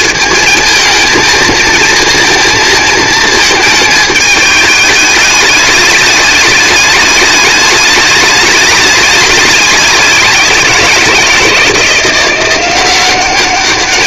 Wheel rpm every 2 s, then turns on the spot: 220, 230, 210, 210, 210, 180, 180.
none